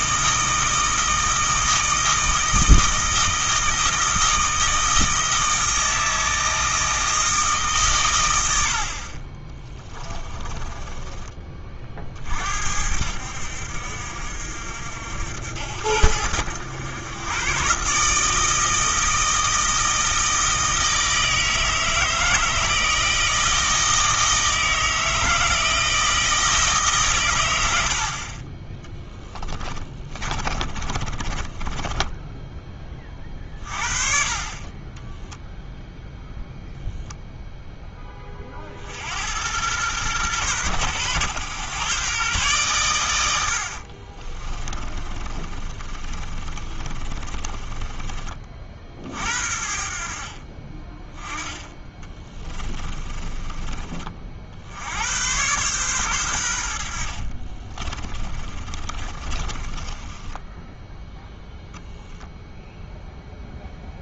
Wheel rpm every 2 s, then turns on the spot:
160, 160, 160, 160, 80, 30, 60, 60, 90, 160, 160, 160, 160, 160, 30, 30, 10, 30, 0, 40, 120, 120, 30, 30, 40, 30, 20, 70, 90, 30, 10, 0.
10-12 30-32 44-48 52-54 58-62